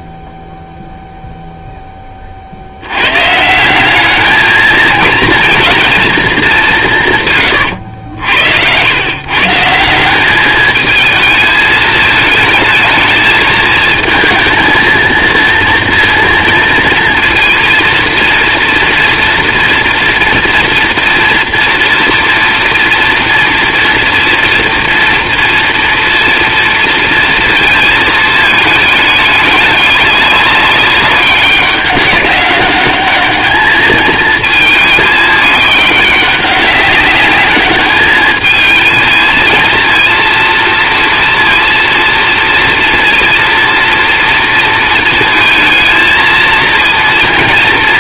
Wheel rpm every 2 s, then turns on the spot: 0, 70, 220, 190, 90, 210, 220, 230, 230, 230, 240, 240, 230, 230, 220, 200, 200, 220, 200, 220, 230, 230, 230, 230.
none